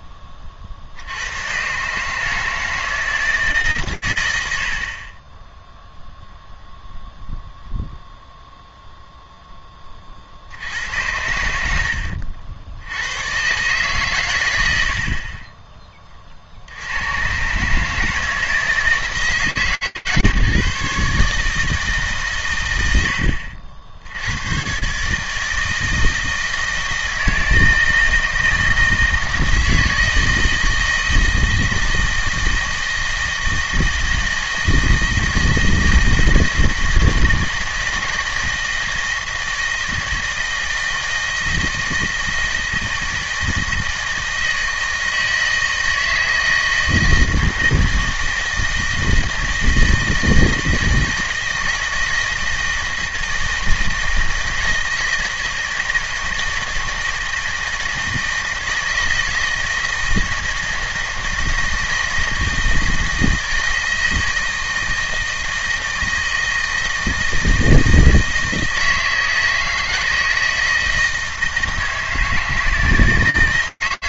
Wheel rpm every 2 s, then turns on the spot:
50, 160, 60, 0, 0, 90, 110, 30, 120, 150, 150, 100, 160, 160, 160, 160, 160, 160, 160, 160, 160, 160, 160, 160, 160, 160, 160, 160, 160, 160, 160, 160, 160, 160, 160, 160, 150.
none